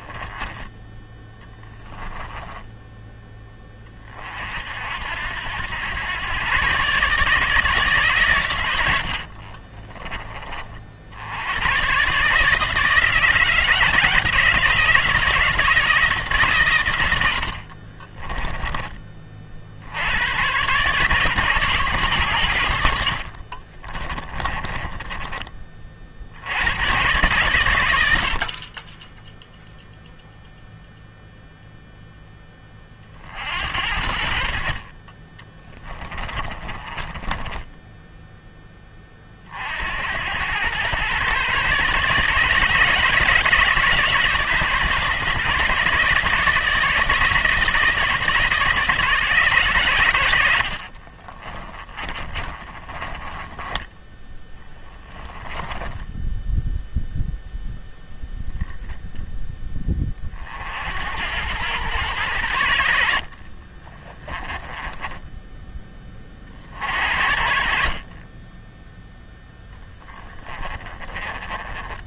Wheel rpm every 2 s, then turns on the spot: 10, 10, 60, 130, 90, 40, 160, 160, 120, 30, 140, 80, 20, 100, 20, 0, 30, 30, 20, 20, 120, 160, 160, 160, 150, 50, 30, 10, 0, 0, 70, 70, 10, 50, 0, 20.
2-4 8-10 22-26 36-38 50-56 64-66 70-72